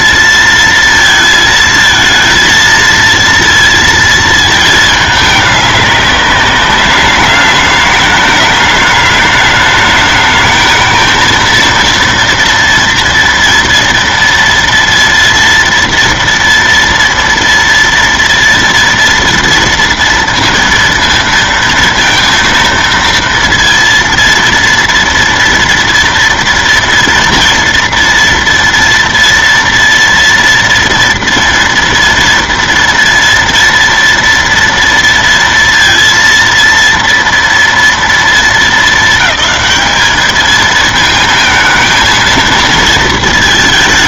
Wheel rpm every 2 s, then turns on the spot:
230, 230, 220, 200, 210, 220, 240, 230, 230, 230, 230, 230, 230, 230, 230, 230, 230, 230, 230, 220, 220, 230.
none